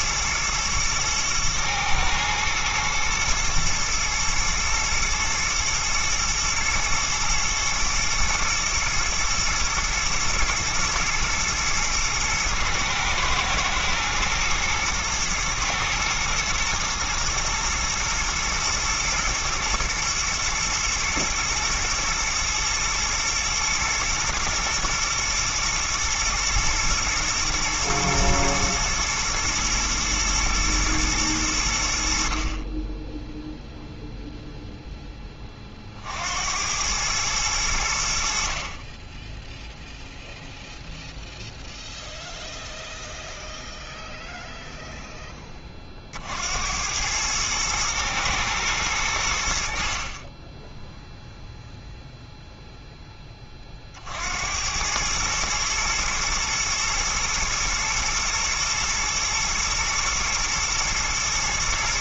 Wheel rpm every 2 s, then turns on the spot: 120, 110, 120, 110, 120, 120, 110, 110, 110, 110, 110, 120, 120, 120, 110, 110, 20, 0, 90, 40, 0, 0, 0, 90, 110, 10, 0, 100, 120, 120, 120.
none